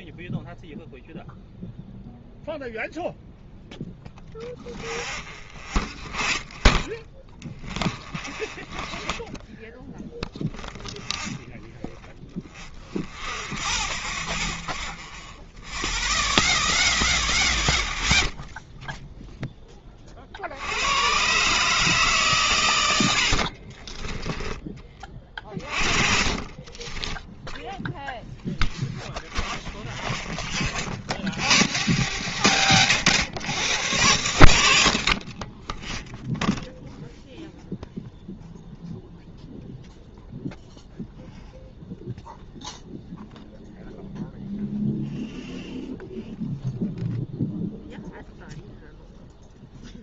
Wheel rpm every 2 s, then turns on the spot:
0, 0, 0, 10, 30, 0, 10, 0, 0, 0, 80, 120, 20, 30, 10, 30, 90, 80, 0, 0, 0, 0, 0, 0, 0.
8-10 12-14 26-28